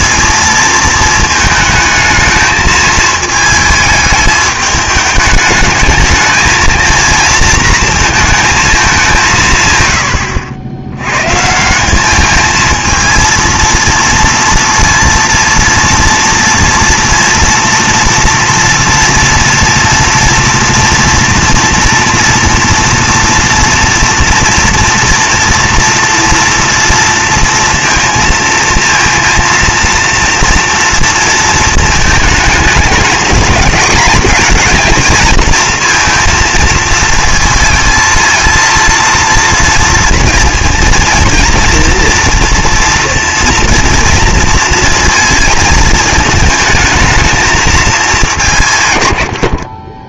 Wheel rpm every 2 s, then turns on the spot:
230, 220, 210, 220, 220, 80, 220, 230, 230, 230, 230, 230, 230, 230, 230, 230, 210, 220, 230, 230, 230, 230, 230, 220, 150.
none